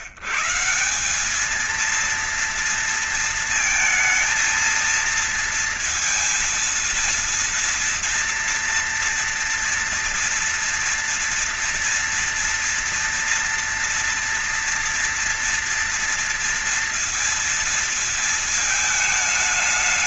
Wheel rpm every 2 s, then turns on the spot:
140, 230, 230, 230, 230, 240, 230, 230, 230, 230.
none